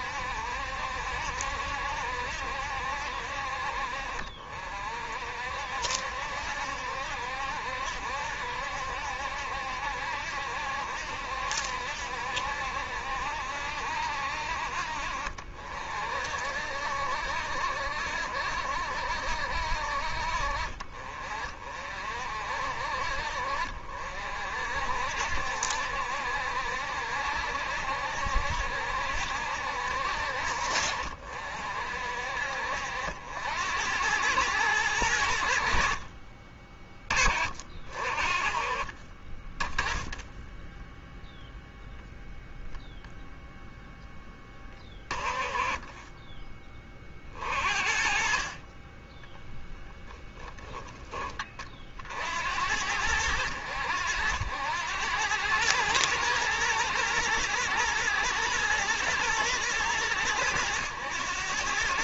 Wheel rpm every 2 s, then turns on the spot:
70, 70, 60, 70, 70, 70, 70, 60, 60, 70, 50, 50, 60, 70, 70, 60, 60, 100, 30, 40, 10, 0, 20, 30, 30, 10, 80, 90, 110, 120, 100.
40-42